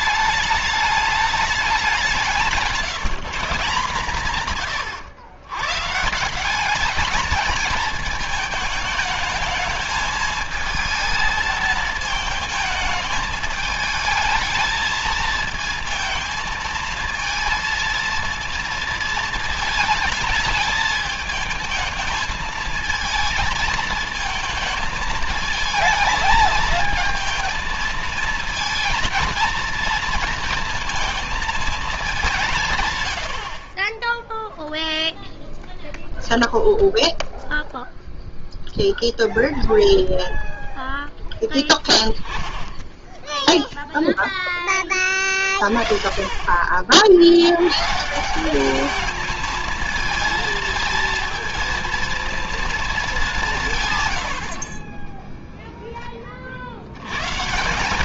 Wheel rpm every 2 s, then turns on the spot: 210, 170, 140, 190, 220, 220, 220, 220, 220, 230, 220, 220, 220, 220, 230, 230, 160, 0, 0, 0, 0, 10, 10, 50, 180, 220, 230, 50, 50.
2-6